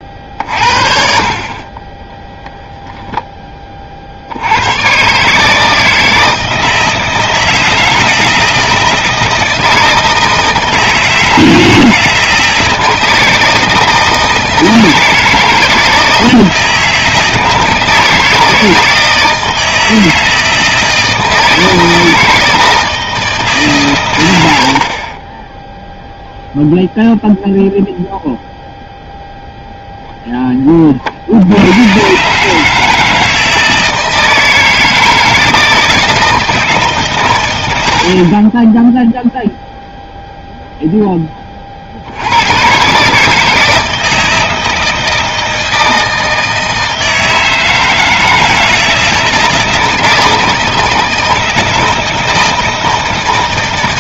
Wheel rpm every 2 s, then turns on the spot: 60, 0, 90, 160, 160, 160, 160, 160, 160, 160, 160, 160, 80, 0, 0, 10, 150, 160, 160, 20, 0, 100, 160, 160, 160, 160, 160.
38-40